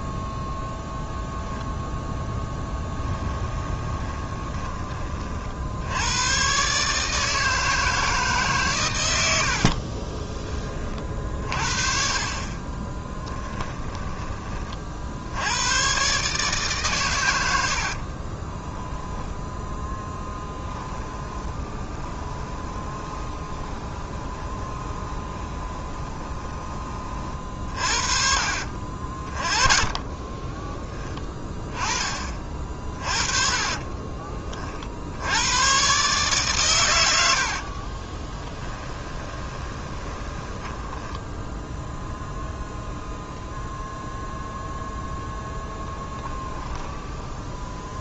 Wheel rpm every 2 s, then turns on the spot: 0, 10, 30, 150, 110, 40, 20, 50, 130, 10, 20, 20, 20, 30, 40, 30, 40, 60, 110, 20, 10, 0, 0, 10.
2-4 12-14 18-26 28-30 32-34 38-42 46-48